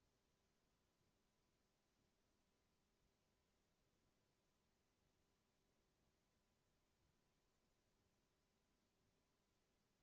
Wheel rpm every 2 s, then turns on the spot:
0, 0, 0, 0, 0.
none